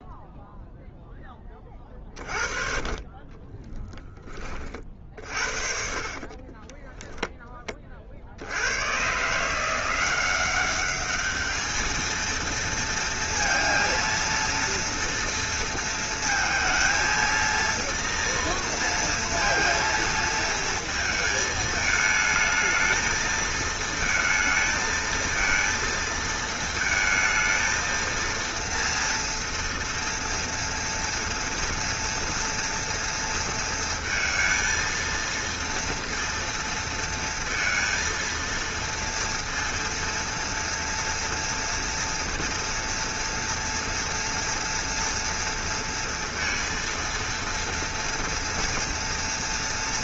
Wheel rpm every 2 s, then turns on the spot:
0, 30, 40, 30, 90, 190, 230, 230, 230, 230, 230, 220, 220, 220, 230, 230, 230, 230, 230, 230, 230, 230, 230, 230, 230.
6-8